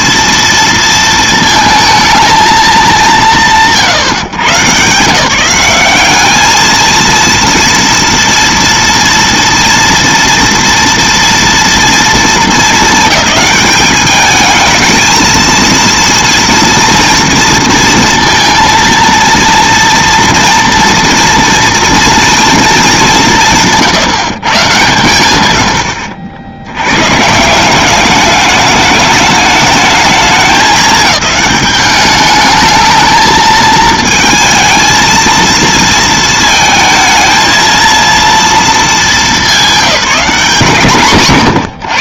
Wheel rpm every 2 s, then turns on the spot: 230, 220, 130, 190, 230, 230, 220, 210, 230, 230, 230, 230, 150, 80, 200, 210, 210, 220, 230, 230, 190.
none